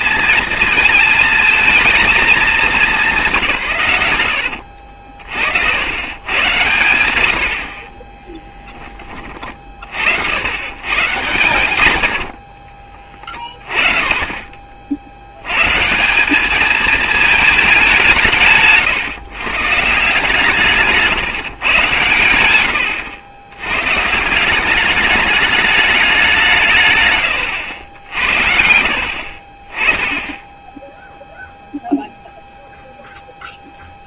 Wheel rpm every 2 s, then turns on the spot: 220, 210, 70, 110, 20, 110, 30, 60, 220, 130, 150, 90, 200, 140, 70, 10, 0.
4-6 22-24 28-30